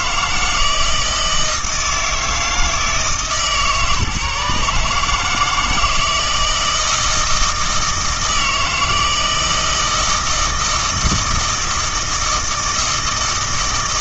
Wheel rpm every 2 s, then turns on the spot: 160, 160, 150, 160, 160, 160, 160.
none